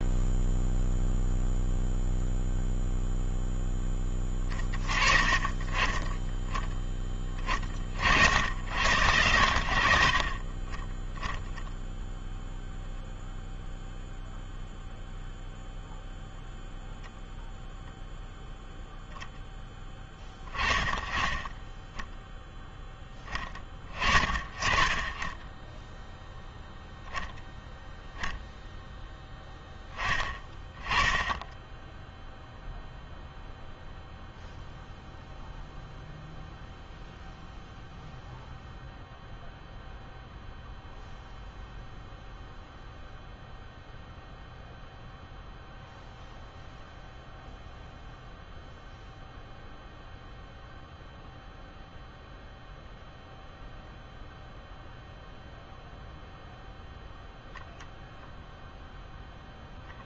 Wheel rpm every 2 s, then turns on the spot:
0, 0, 20, 20, 60, 40, 0, 0, 0, 0, 10, 0, 30, 0, 0, 10, 0, 0, 0, 0, 0, 0, 0, 0, 0, 0, 0, 0, 0, 0.
none